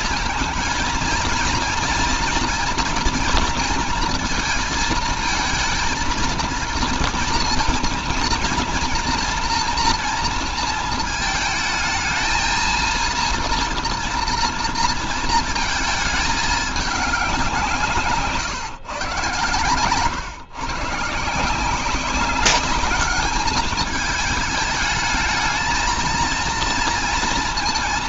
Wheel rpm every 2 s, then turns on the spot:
230, 230, 220, 230, 230, 230, 230, 230, 210, 130, 150, 200, 220, 230.
none